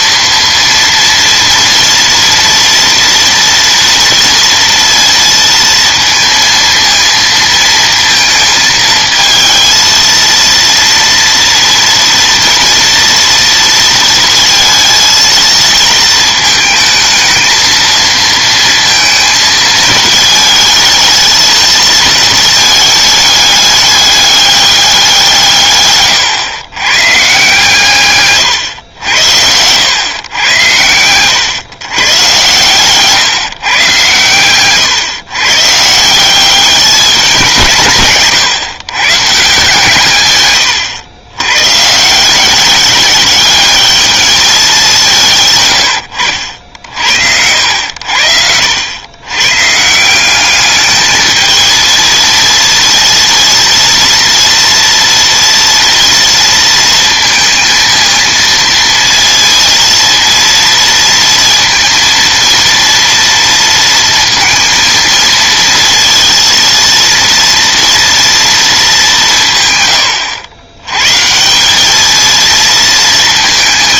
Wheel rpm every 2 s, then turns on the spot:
230, 240, 230, 230, 220, 230, 230, 230, 220, 230, 220, 220, 200, 120, 110, 110, 130, 120, 200, 140, 120, 190, 200, 70, 80, 210, 230, 230, 230, 230, 230, 230, 230, 230, 220, 110, 230.
40-42